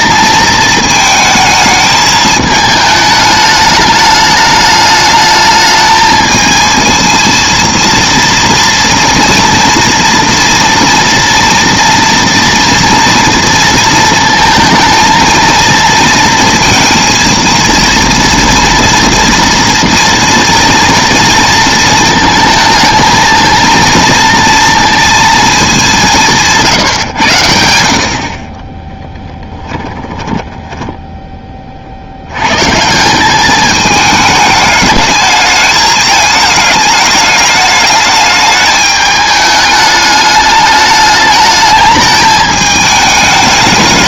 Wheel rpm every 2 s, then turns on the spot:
220, 220, 210, 220, 230, 230, 230, 220, 230, 230, 230, 220, 230, 150, 20, 10, 140, 220, 210, 210, 210, 210.
30-32